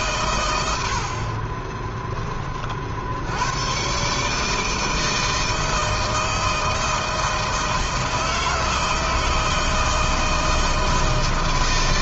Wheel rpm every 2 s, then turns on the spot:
80, 50, 160, 160, 160, 160.
none